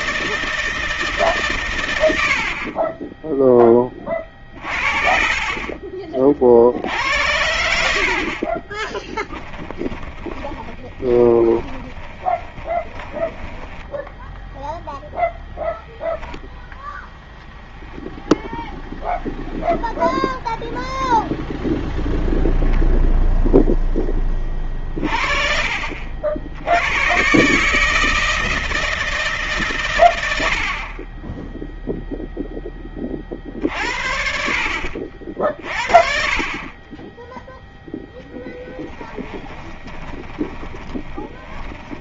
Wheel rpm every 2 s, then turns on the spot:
150, 20, 40, 70, 30, 20, 10, 0, 0, 0, 0, 0, 40, 110, 160, 30, 30, 50, 20, 10, 20.
8-14 38-42